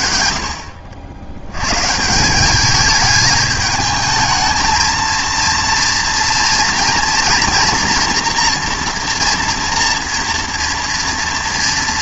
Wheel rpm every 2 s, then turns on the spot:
60, 210, 230, 230, 230, 240.
none